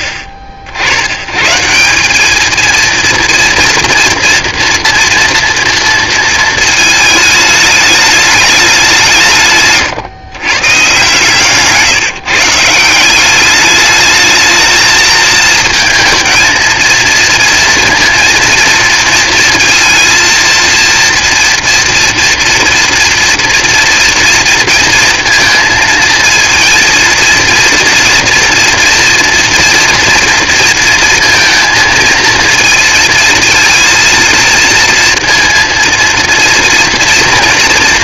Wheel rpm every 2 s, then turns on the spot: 50, 230, 230, 220, 180, 140, 170, 220, 230, 230, 230, 240, 230, 230, 230, 230, 230, 230, 230.
none